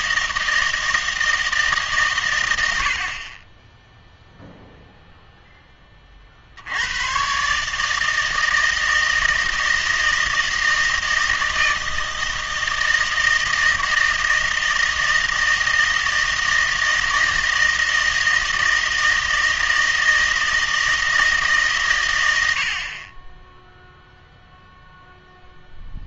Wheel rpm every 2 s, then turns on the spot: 160, 80, 0, 80, 160, 160, 160, 160, 160, 160, 160, 60, 0.
none